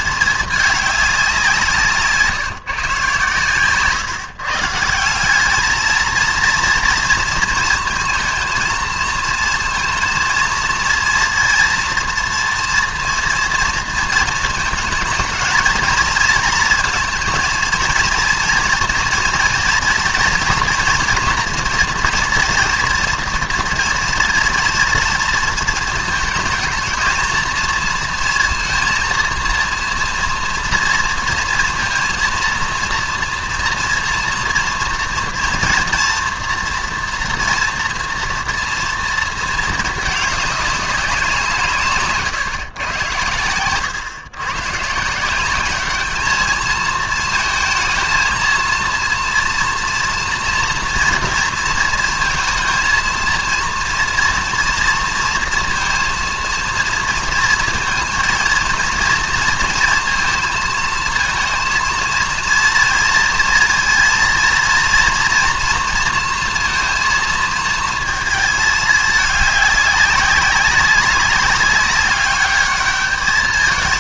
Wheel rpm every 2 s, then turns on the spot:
220, 160, 140, 220, 230, 230, 240, 230, 220, 230, 240, 240, 230, 220, 230, 230, 230, 230, 230, 230, 220, 150, 120, 210, 230, 230, 230, 230, 230, 230, 230, 230, 230, 230, 220, 200, 200.
none